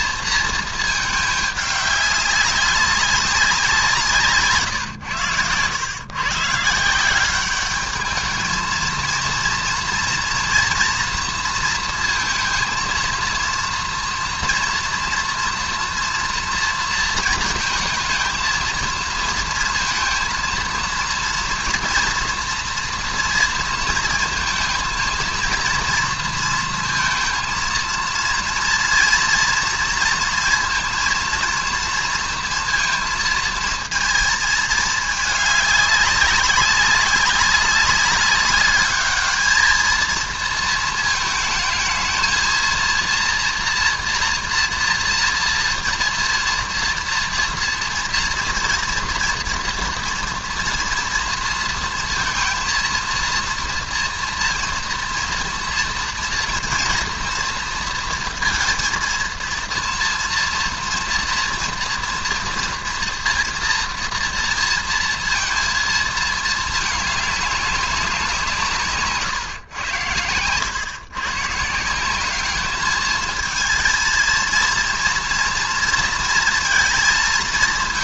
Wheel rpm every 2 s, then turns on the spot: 230, 200, 150, 140, 220, 240, 230, 230, 230, 230, 230, 230, 230, 230, 230, 230, 230, 220, 200, 200, 230, 230, 230, 230, 230, 230, 230, 230, 240, 230, 230, 230, 230, 220, 170, 110, 210, 230, 230.
none